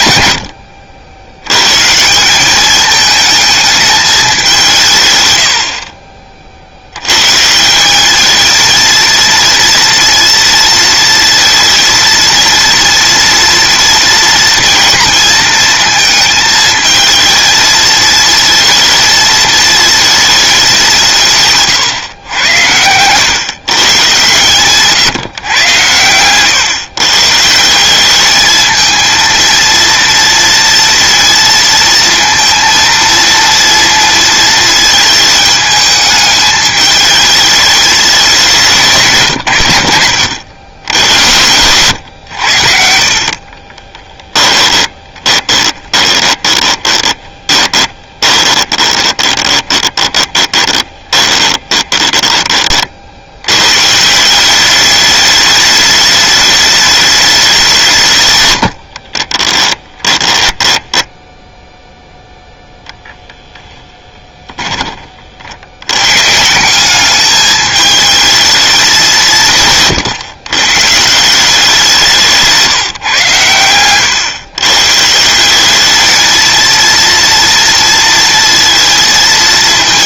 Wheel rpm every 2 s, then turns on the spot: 70, 210, 170, 80, 220, 230, 230, 230, 220, 230, 190, 100, 140, 130, 220, 230, 230, 220, 210, 160, 80, 60, 30, 20, 20, 20, 40, 200, 210, 70, 10, 0, 20, 190, 200, 140, 150, 140, 230, 230.
44-52 58-62